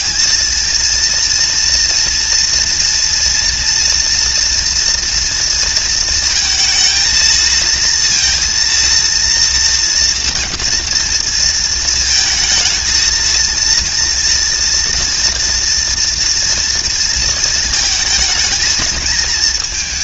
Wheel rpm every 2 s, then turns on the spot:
230, 230, 240, 220, 230, 230, 220, 230, 230, 220.
none